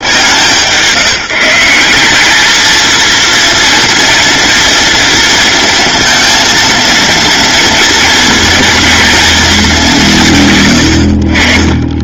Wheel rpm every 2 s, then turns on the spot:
160, 220, 230, 230, 220, 110.
none